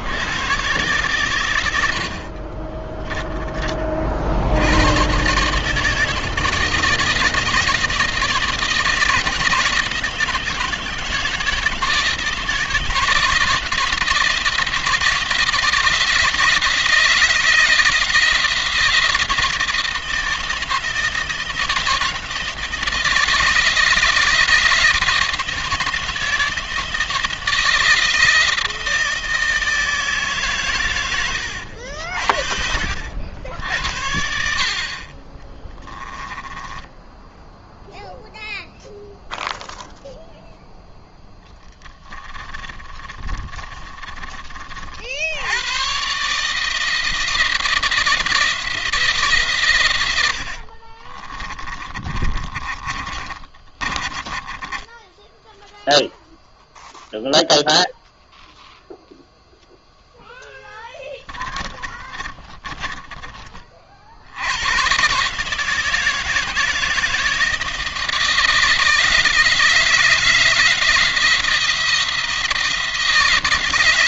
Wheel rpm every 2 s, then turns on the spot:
120, 20, 120, 160, 160, 160, 170, 160, 160, 160, 160, 160, 160, 160, 160, 110, 60, 40, 10, 0, 0, 30, 60, 160, 150, 30, 30, 10, 0, 0, 10, 20, 120, 160, 160, 160, 160.
34-38 42-44 50-56 60-62